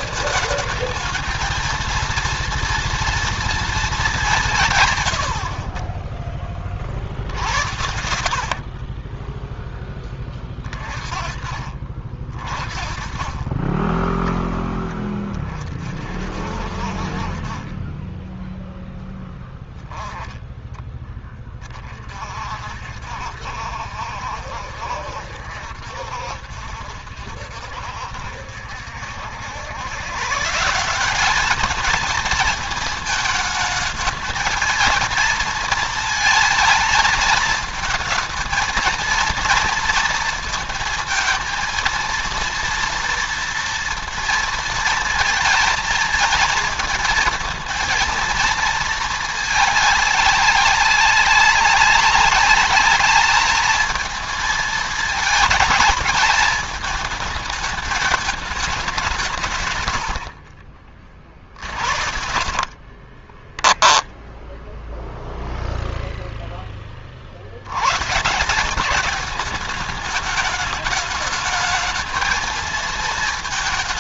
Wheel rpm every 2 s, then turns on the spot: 220, 230, 140, 40, 50, 30, 40, 10, 50, 10, 10, 50, 70, 60, 60, 160, 220, 220, 220, 230, 230, 230, 230, 220, 220, 200, 210, 220, 220, 210, 40, 50, 0, 10, 180, 210, 220.
8-10 62-64